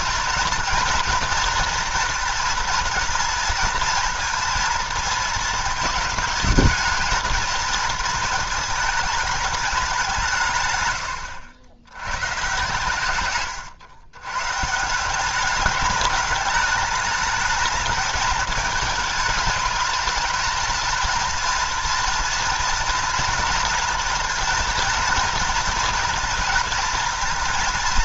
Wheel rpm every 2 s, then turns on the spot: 240, 230, 230, 220, 220, 130, 130, 150, 210, 210, 230, 230, 230, 230.
10-12